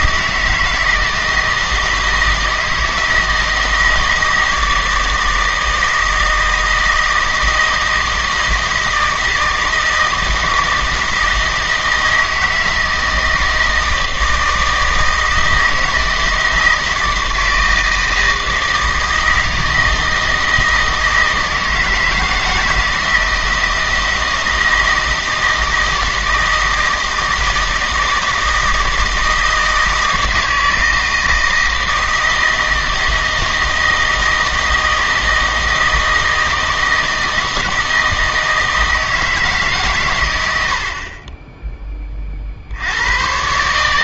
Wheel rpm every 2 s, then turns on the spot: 160, 160, 160, 160, 160, 160, 160, 160, 160, 160, 160, 160, 160, 160, 160, 160, 160, 160, 160, 160, 70, 90.
none